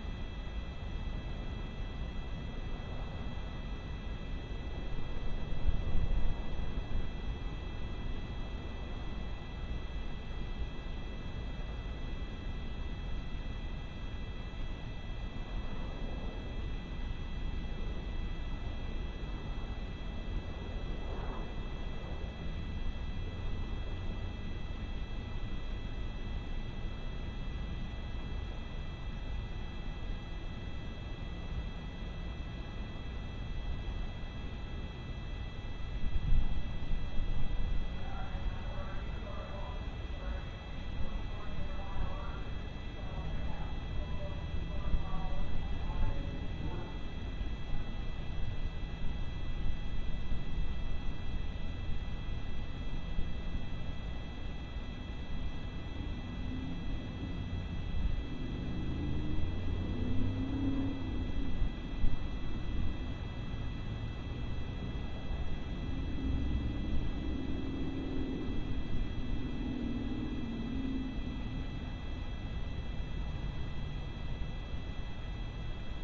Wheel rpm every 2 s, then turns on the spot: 0, 0, 0, 0, 0, 0, 0, 0, 0, 0, 0, 0, 0, 0, 0, 0, 0, 0, 0, 0, 0, 0, 0, 0, 0, 0, 0, 0, 0, 0, 0, 0, 0, 0, 0, 0, 0, 0.
none